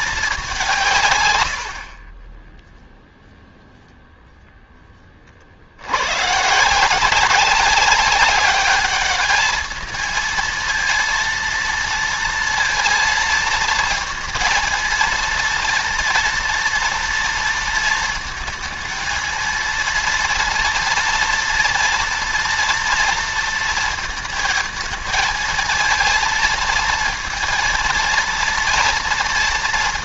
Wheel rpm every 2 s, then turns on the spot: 160, 0, 30, 180, 210, 230, 220, 230, 230, 230, 230, 230, 220, 230, 230.
none